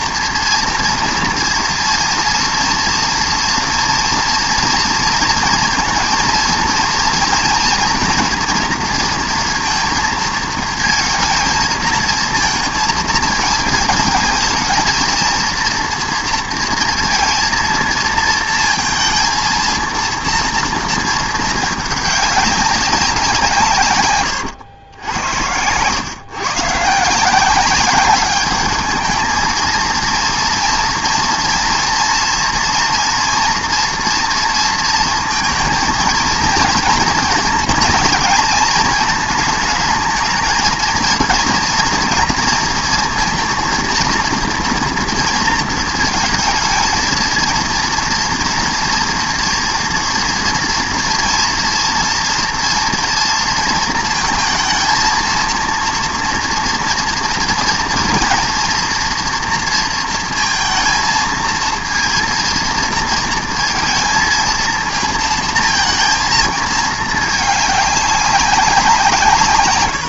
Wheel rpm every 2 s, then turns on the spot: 230, 230, 230, 230, 240, 220, 230, 220, 230, 230, 230, 200, 110, 130, 210, 230, 230, 230, 230, 230, 230, 230, 230, 230, 230, 230, 240, 230, 230, 230, 230, 230, 230, 220, 190.
24-26